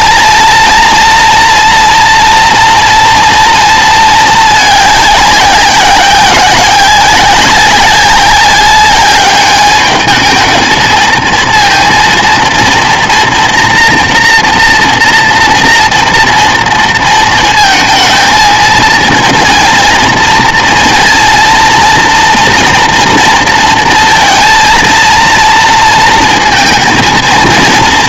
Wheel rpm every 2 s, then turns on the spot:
230, 230, 210, 180, 190, 220, 230, 240, 230, 220, 230, 240, 230, 220.
none